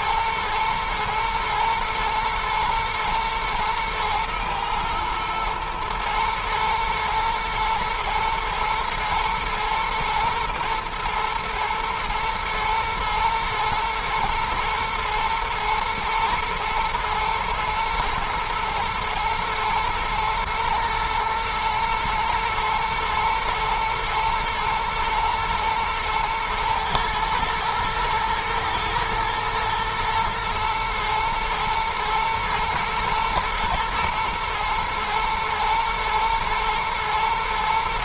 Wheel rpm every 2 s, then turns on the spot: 120, 120, 120, 110, 110, 110, 110, 110, 110, 120, 110, 110, 120, 110, 120, 110, 120, 120, 110.
none